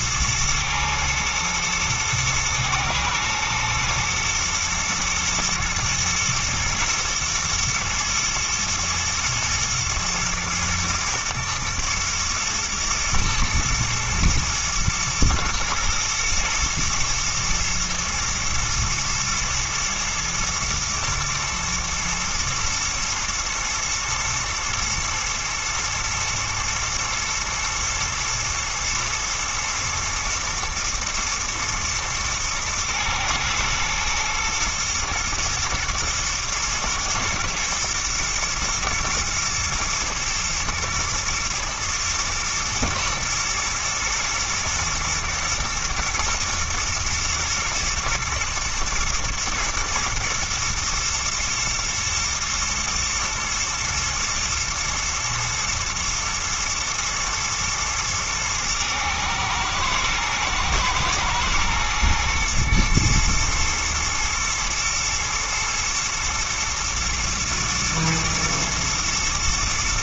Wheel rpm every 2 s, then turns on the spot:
120, 110, 120, 110, 110, 110, 120, 110, 110, 110, 110, 120, 110, 110, 110, 110, 110, 120, 110, 120, 110, 120, 120, 120, 110, 120, 120, 110, 120, 110, 120, 120, 110, 120, 120.
none